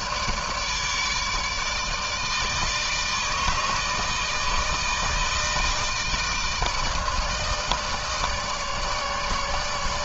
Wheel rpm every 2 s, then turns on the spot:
160, 160, 160, 160, 150.
none